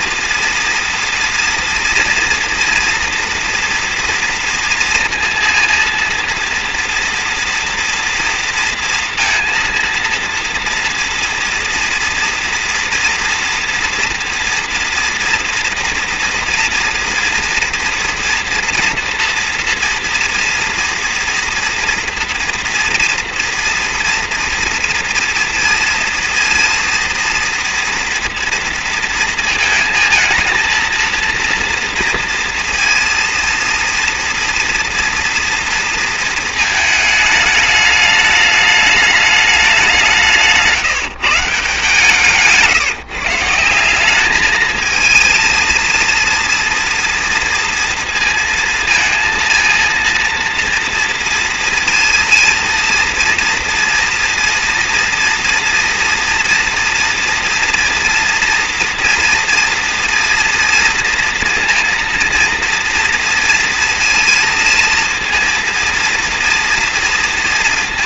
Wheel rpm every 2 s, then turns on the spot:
240, 230, 230, 230, 240, 230, 230, 240, 230, 230, 230, 230, 230, 230, 230, 220, 230, 230, 230, 210, 170, 150, 200, 230, 230, 230, 230, 230, 240, 230, 230, 230, 230, 230.
none